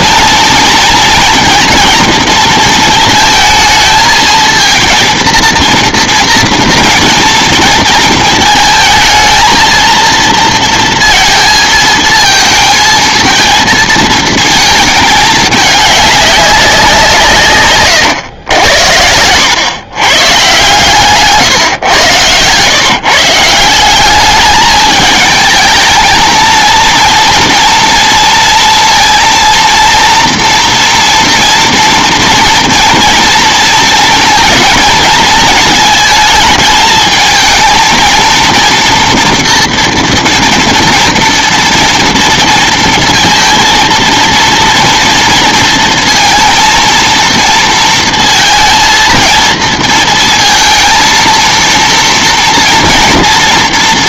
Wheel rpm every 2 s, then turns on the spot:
230, 220, 230, 230, 220, 230, 220, 220, 190, 90, 140, 130, 210, 230, 230, 230, 230, 230, 220, 230, 230, 230, 230, 230, 230, 230, 230.
none